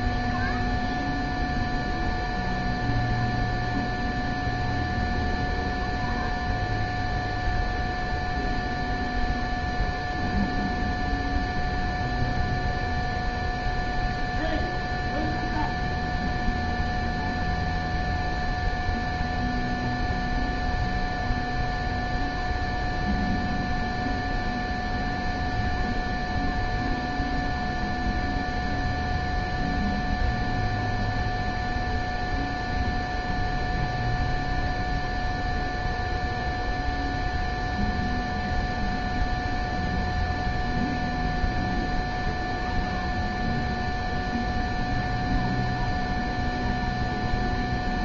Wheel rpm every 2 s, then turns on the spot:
0, 0, 0, 0, 0, 0, 0, 0, 0, 0, 0, 0, 0, 0, 0, 0, 0, 0, 0, 0, 0, 0, 0, 0.
none